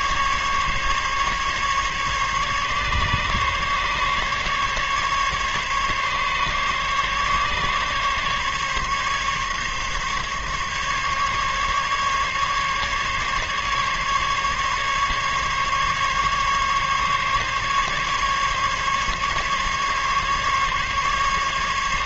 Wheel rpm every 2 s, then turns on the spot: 140, 140, 140, 140, 140, 140, 140, 140, 140, 140, 140.
none